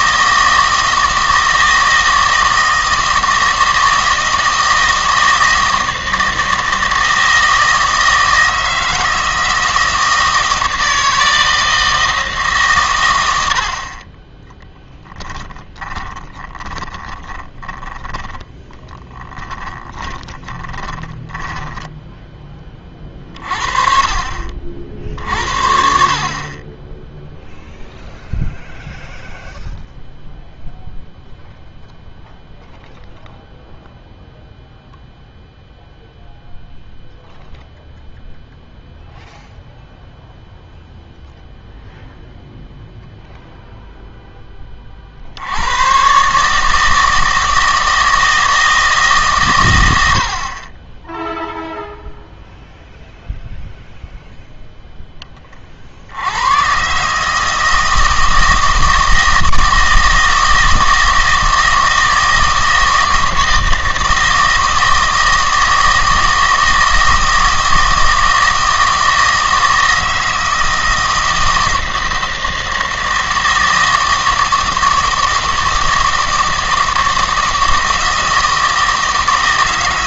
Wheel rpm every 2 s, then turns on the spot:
160, 160, 160, 160, 160, 160, 130, 10, 20, 10, 20, 30, 60, 20, 0, 0, 0, 0, 0, 0, 0, 0, 30, 150, 160, 30, 0, 0, 120, 160, 160, 160, 160, 160, 160, 160, 160, 160, 160, 160.
14-22